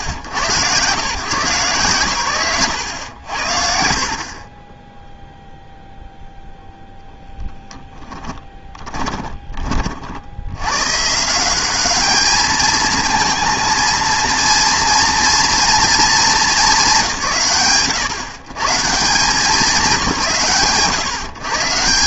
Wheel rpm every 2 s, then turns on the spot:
110, 110, 0, 0, 20, 80, 220, 230, 210, 90, 130.
8-10